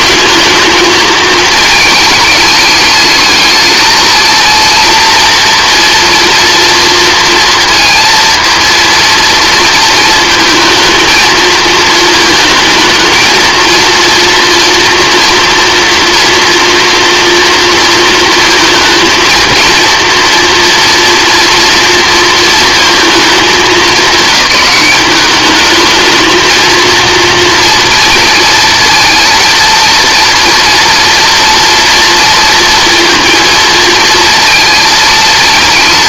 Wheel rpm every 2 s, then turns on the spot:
220, 210, 230, 230, 230, 220, 220, 240, 230, 230, 230, 230, 210, 230, 230, 230, 230, 230.
none